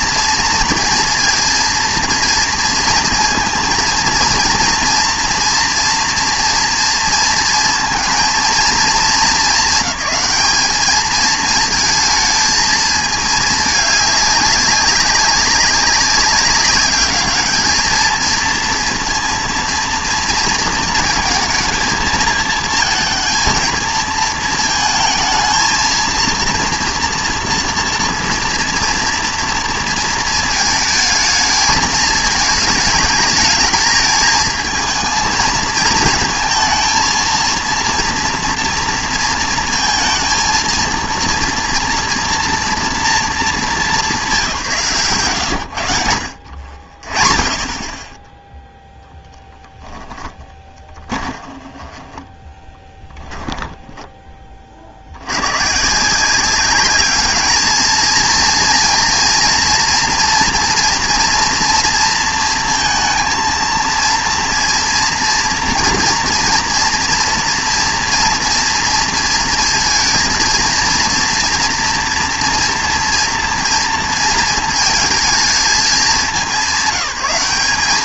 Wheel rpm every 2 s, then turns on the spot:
230, 220, 230, 230, 220, 210, 220, 200, 200, 230, 230, 220, 220, 230, 230, 220, 220, 220, 230, 230, 230, 230, 150, 60, 10, 20, 20, 40, 190, 230, 230, 230, 230, 230, 230, 230, 230, 230, 200.
50-54